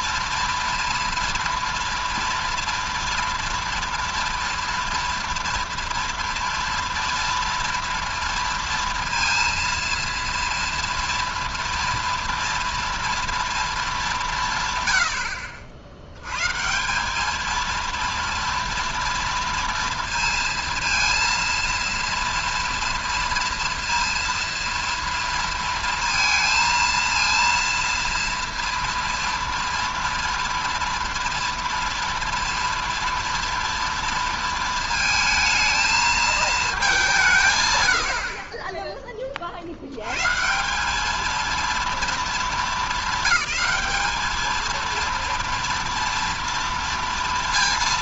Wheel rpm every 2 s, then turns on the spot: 230, 230, 230, 230, 230, 230, 230, 130, 160, 230, 230, 230, 230, 230, 230, 240, 230, 230, 220, 30, 180, 210, 220, 230.
none